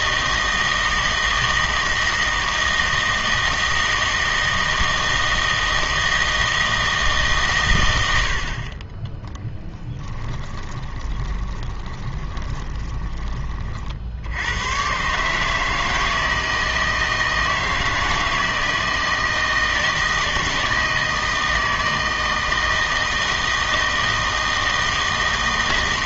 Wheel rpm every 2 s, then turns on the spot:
160, 160, 160, 160, 60, 30, 20, 110, 160, 160, 160, 160, 160.
10-14